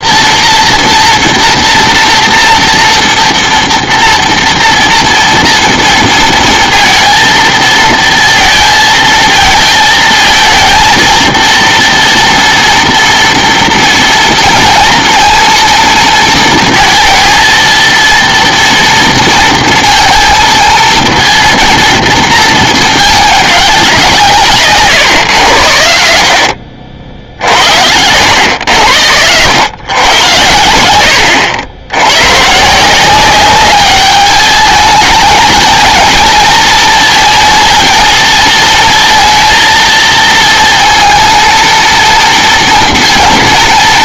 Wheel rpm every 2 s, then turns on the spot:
240, 230, 230, 230, 230, 230, 230, 230, 230, 230, 230, 220, 140, 70, 100, 80, 160, 210, 230, 230, 230, 230.
26-28